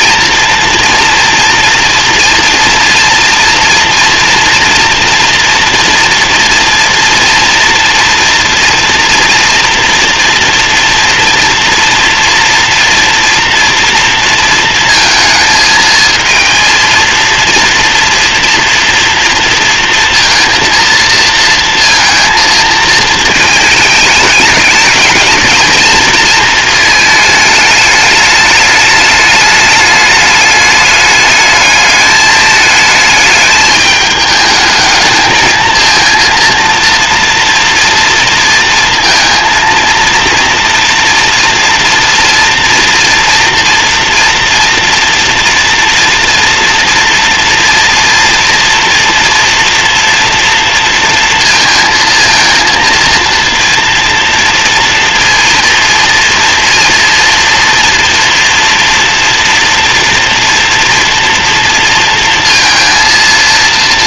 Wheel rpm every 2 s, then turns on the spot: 230, 230, 240, 230, 230, 240, 230, 220, 230, 230, 230, 220, 210, 220, 210, 210, 220, 220, 230, 230, 230, 240, 230, 240, 240, 230, 230, 240, 240, 240, 230, 230.
none